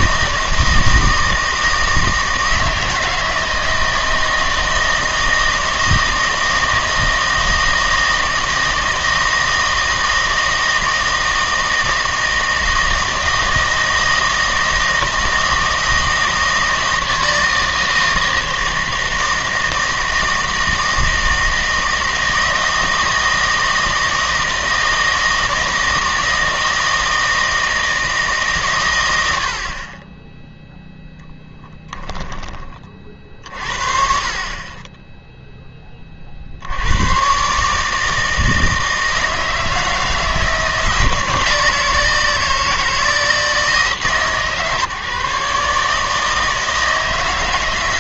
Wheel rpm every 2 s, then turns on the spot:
160, 160, 160, 160, 160, 160, 160, 160, 160, 160, 160, 160, 160, 160, 130, 0, 30, 20, 80, 160, 160, 160, 140, 160.
none